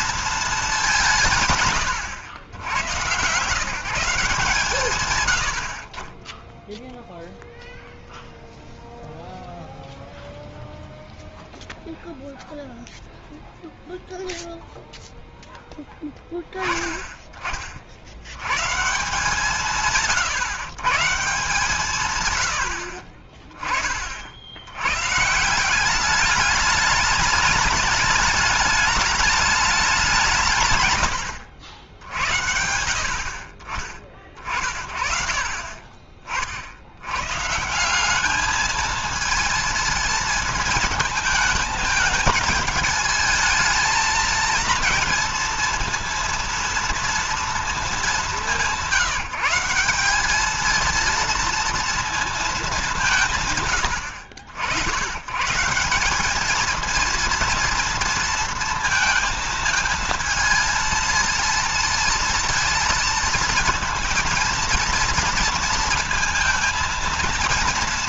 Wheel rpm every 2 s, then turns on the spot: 210, 100, 150, 10, 0, 0, 0, 0, 10, 110, 140, 90, 80, 210, 210, 150, 70, 40, 60, 210, 220, 220, 230, 230, 190, 210, 210, 80, 220, 230, 220, 230, 230, 220.
none